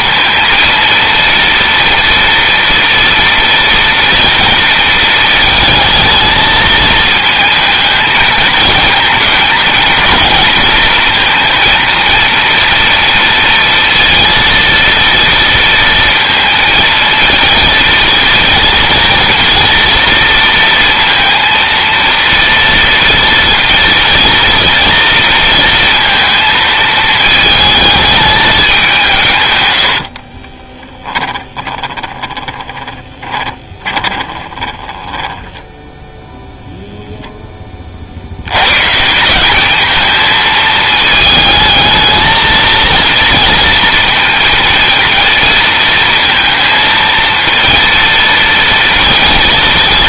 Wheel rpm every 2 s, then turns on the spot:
230, 230, 220, 220, 220, 230, 230, 230, 230, 230, 230, 230, 230, 220, 180, 10, 20, 10, 0, 150, 220, 230, 230, 230, 230.
30-36